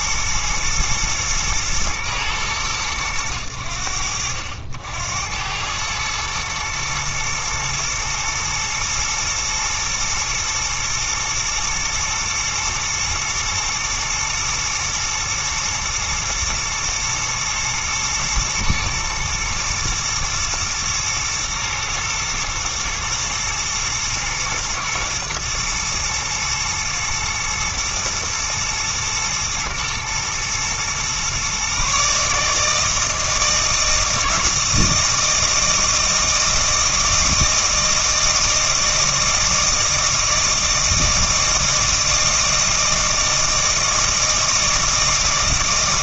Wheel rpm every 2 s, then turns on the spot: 110, 100, 80, 110, 110, 120, 120, 110, 110, 110, 120, 120, 120, 120, 110, 120, 160, 160, 160, 160, 160, 160, 160.
none